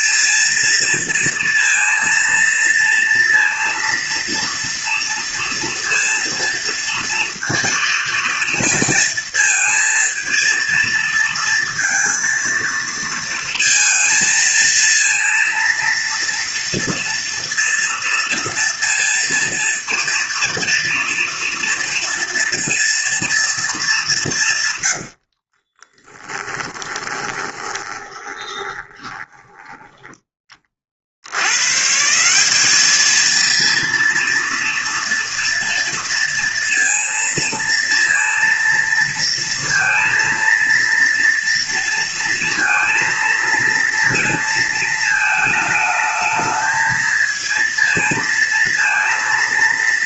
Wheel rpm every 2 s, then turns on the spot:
230, 230, 230, 230, 230, 230, 230, 230, 230, 230, 230, 230, 110, 20, 20, 40, 210, 230, 230, 230, 230, 230, 220, 220, 230.
26-30